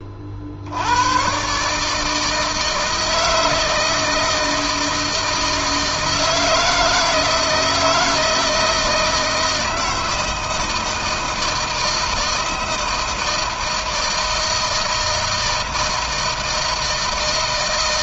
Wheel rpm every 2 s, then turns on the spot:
70, 160, 160, 160, 160, 160, 160, 160, 160.
none